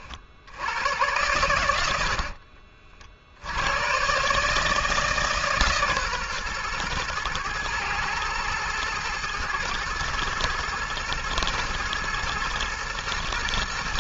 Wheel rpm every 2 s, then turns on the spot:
80, 50, 150, 120, 110, 110, 120.
none